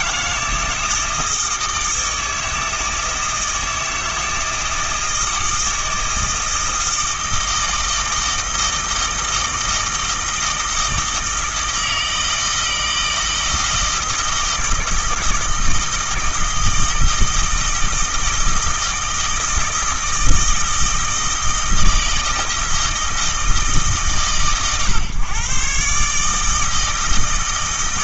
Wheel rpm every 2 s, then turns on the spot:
160, 160, 160, 160, 160, 160, 160, 160, 160, 160, 160, 160, 130, 160.
none